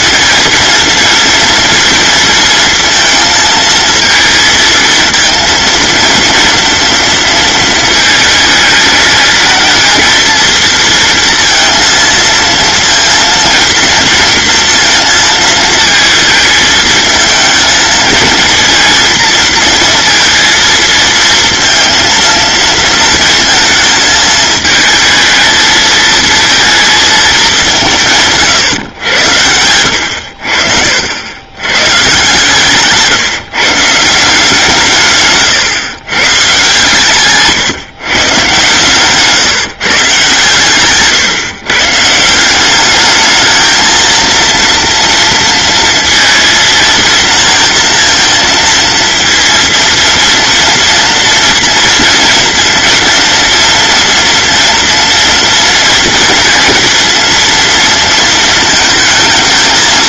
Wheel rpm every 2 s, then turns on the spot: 230, 230, 230, 230, 220, 230, 230, 230, 220, 230, 230, 230, 220, 220, 110, 60, 150, 150, 140, 130, 140, 200, 230, 230, 230, 230, 240, 230, 230, 220.
32-34 40-42